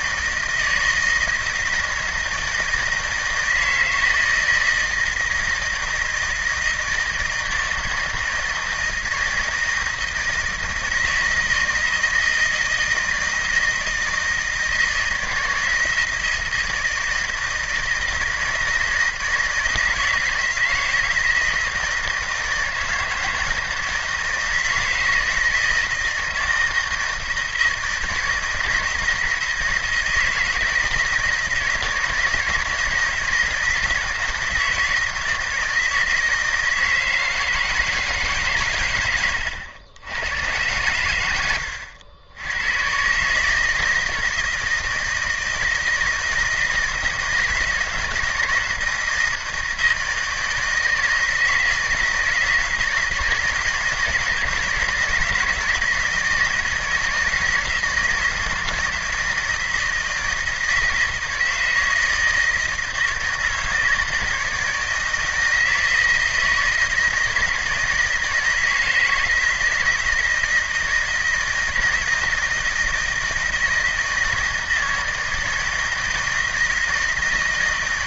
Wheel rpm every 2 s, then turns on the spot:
160, 160, 160, 160, 160, 160, 160, 160, 160, 160, 170, 160, 160, 160, 160, 160, 170, 160, 160, 130, 100, 110, 160, 160, 160, 160, 160, 160, 160, 160, 160, 160, 160, 160, 160, 160, 160, 160, 160.
none